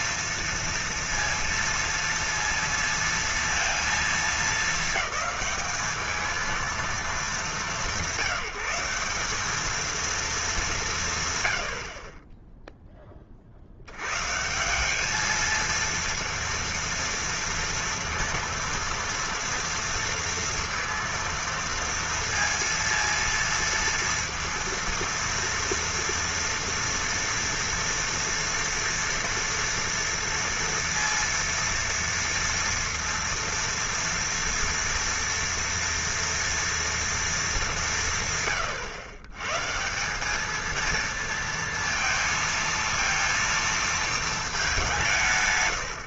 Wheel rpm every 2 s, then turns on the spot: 230, 230, 220, 220, 180, 190, 10, 190, 230, 230, 230, 230, 230, 230, 230, 230, 230, 240, 230, 120, 230, 230, 170.
none